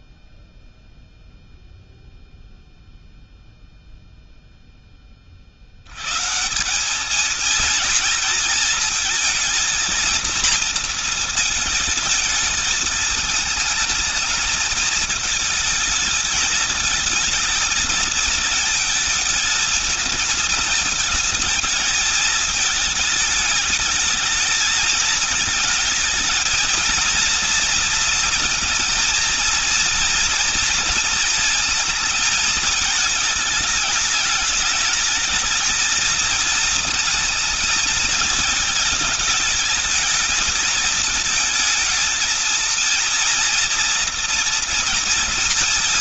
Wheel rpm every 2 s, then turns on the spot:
0, 0, 10, 170, 230, 230, 220, 220, 220, 220, 220, 220, 220, 230, 230, 240, 220, 210, 230, 220, 220, 230, 230.
none